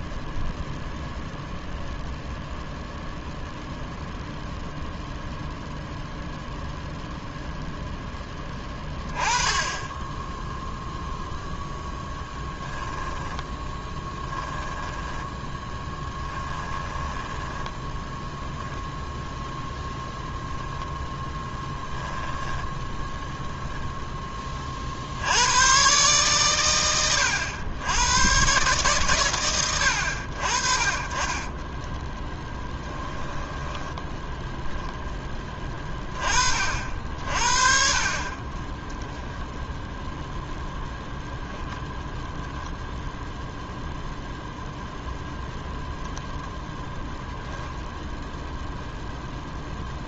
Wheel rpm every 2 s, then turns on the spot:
0, 0, 0, 0, 20, 0, 10, 10, 10, 0, 10, 10, 70, 80, 140, 40, 10, 10, 60, 10, 10, 0, 0, 0, 0.
12-18 32-34 38-40